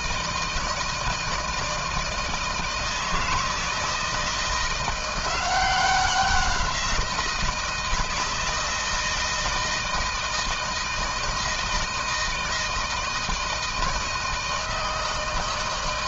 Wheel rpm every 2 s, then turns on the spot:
160, 160, 170, 180, 160, 160, 160, 160.
none